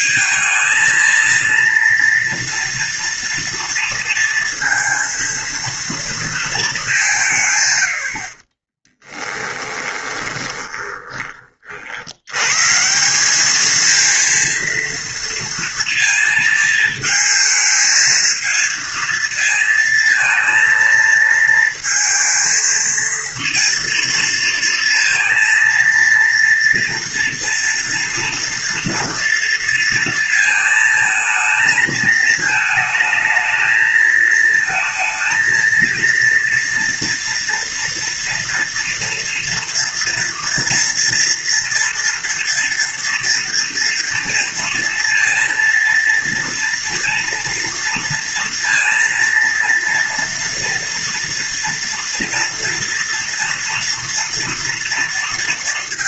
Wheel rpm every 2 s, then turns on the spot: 220, 230, 230, 200, 20, 20, 150, 230, 220, 220, 230, 230, 230, 230, 230, 220, 220, 220, 230, 230, 230, 230, 230, 230, 230, 230, 230, 230.
8-12